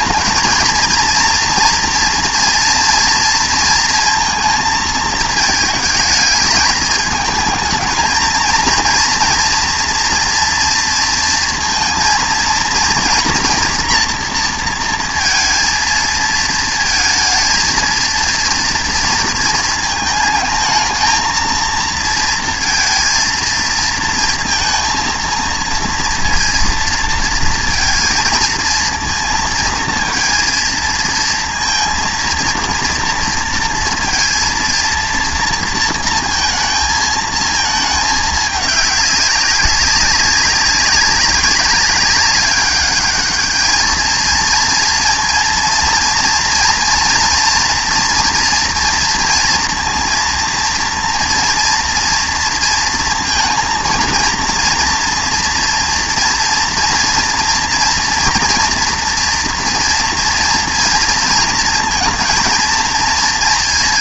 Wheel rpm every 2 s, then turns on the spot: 220, 230, 230, 220, 230, 230, 230, 230, 220, 230, 220, 230, 230, 230, 230, 230, 230, 230, 230, 210, 200, 200, 230, 230, 230, 230, 230, 230, 230, 230, 240, 230.
none